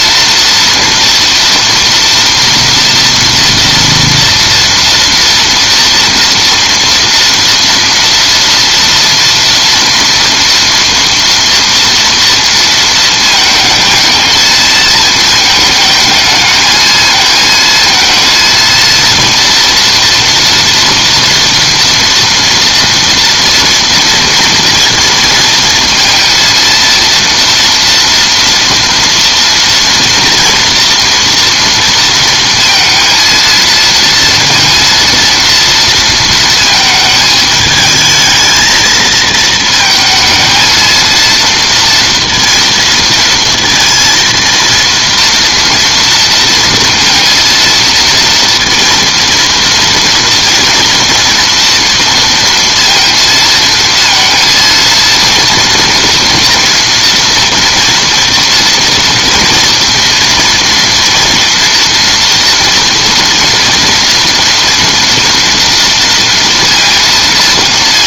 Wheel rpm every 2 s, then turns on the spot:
230, 230, 230, 230, 230, 230, 230, 230, 220, 230, 230, 230, 230, 230, 230, 230, 230, 230, 220, 220, 230, 230, 230, 230, 230, 230, 230, 230, 240, 230, 230, 230, 230, 230.
none